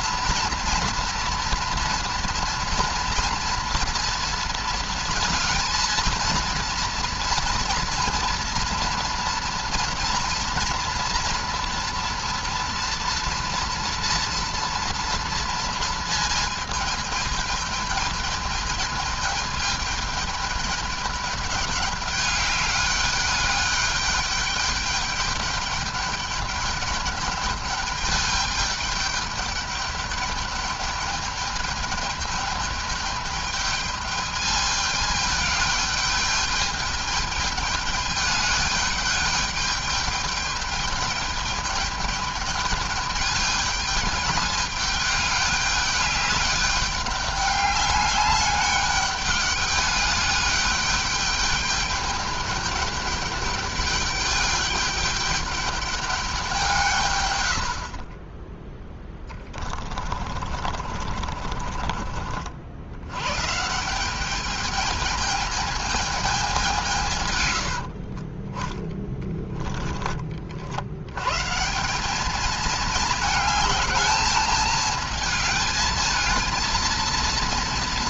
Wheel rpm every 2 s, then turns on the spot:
230, 230, 220, 230, 230, 230, 240, 240, 220, 220, 210, 200, 210, 210, 210, 210, 210, 210, 210, 210, 210, 210, 210, 200, 200, 210, 210, 200, 150, 10, 40, 70, 220, 180, 20, 70, 220, 220, 220.
60-62